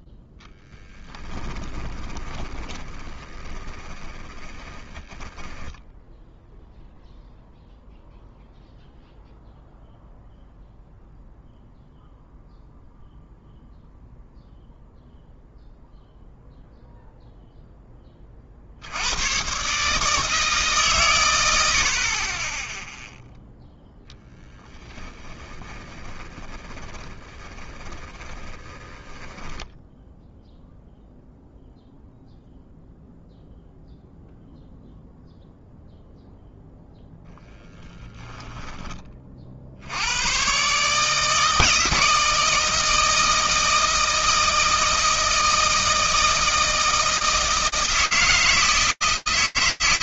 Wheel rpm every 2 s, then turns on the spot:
0, 20, 20, 0, 0, 0, 0, 0, 0, 60, 140, 10, 10, 20, 10, 0, 0, 0, 0, 10, 130, 160, 160, 160, 160.
2-6 24-30 38-40